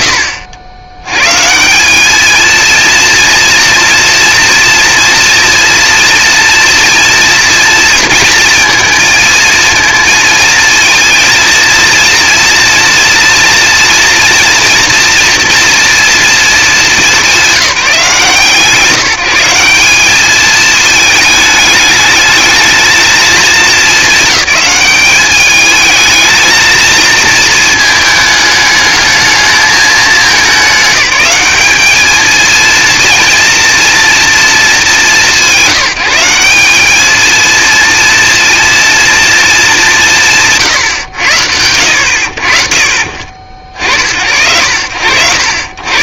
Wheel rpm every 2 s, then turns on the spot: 110, 230, 230, 230, 220, 220, 230, 230, 190, 170, 220, 210, 210, 220, 210, 200, 230, 180, 220, 220, 100, 60, 60.
none